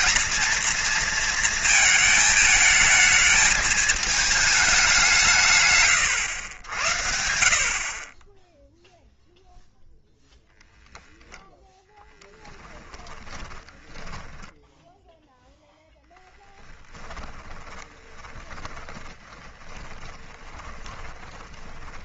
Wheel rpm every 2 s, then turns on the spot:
230, 220, 190, 80, 0, 10, 20, 10, 10, 20, 20.
12-22